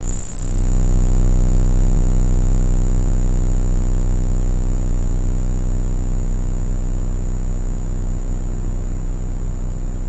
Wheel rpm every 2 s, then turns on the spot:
0, 0, 0, 0, 0.
none